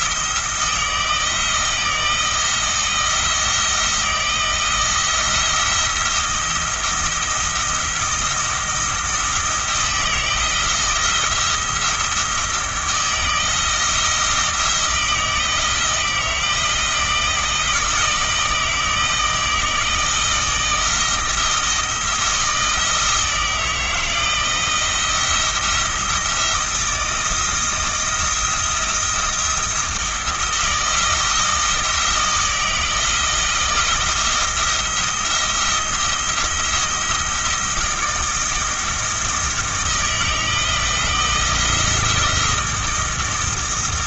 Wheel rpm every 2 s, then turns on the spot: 160, 160, 170, 170, 170, 170, 170, 160, 160, 160, 160, 160, 170, 160, 170, 170, 160, 160, 170, 170, 170, 170.
none